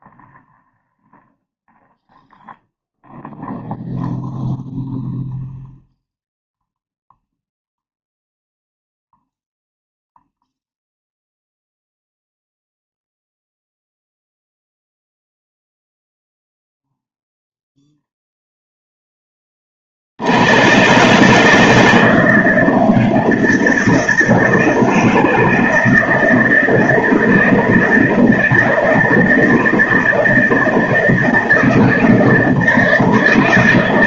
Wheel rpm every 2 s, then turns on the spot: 0, 0, 0, 0, 0, 0, 0, 0, 0, 0, 130, 160, 160, 160, 160, 160, 160.
none